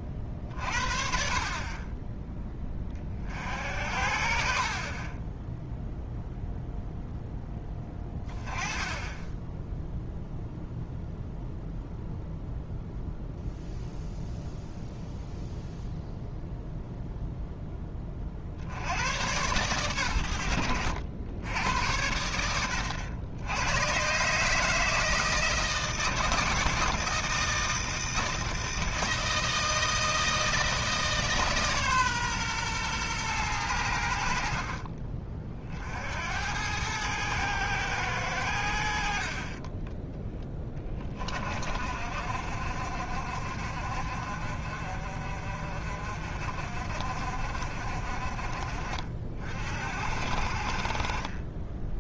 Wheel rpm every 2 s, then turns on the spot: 40, 20, 50, 0, 20, 0, 0, 0, 0, 70, 90, 100, 150, 160, 160, 160, 120, 50, 100, 80, 20, 50, 50, 40, 40, 60.
none